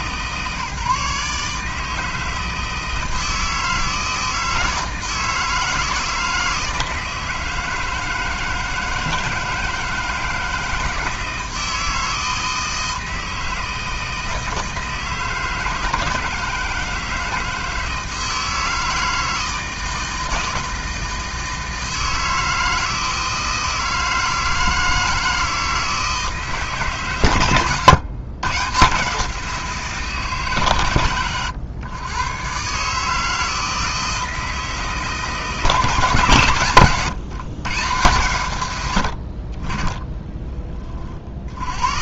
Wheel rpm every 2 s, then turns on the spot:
140, 160, 160, 160, 160, 160, 160, 160, 160, 160, 160, 160, 160, 160, 140, 150, 120, 160, 130, 110, 20.
none